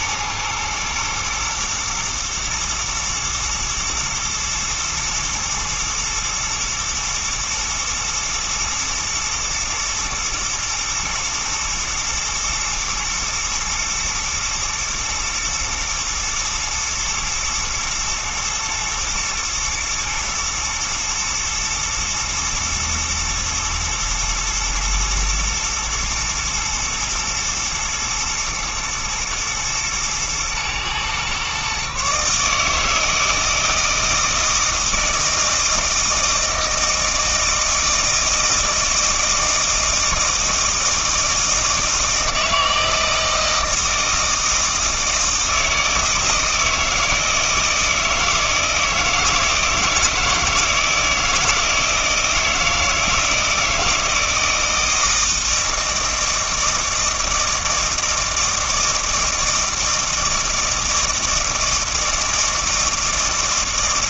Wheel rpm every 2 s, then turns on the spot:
120, 110, 110, 110, 120, 110, 110, 110, 120, 120, 110, 110, 120, 120, 110, 120, 150, 160, 160, 160, 160, 160, 160, 160, 160, 160, 160, 160, 160, 160, 160, 160.
none